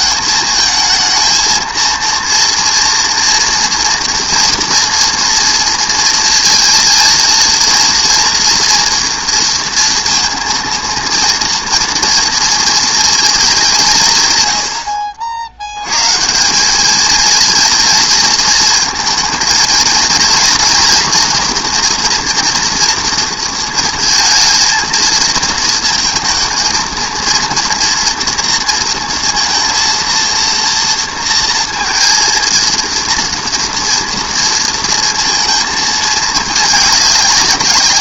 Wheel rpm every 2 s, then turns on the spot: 220, 230, 230, 230, 230, 230, 230, 100, 200, 220, 230, 230, 230, 230, 230, 230, 230, 230, 200.
none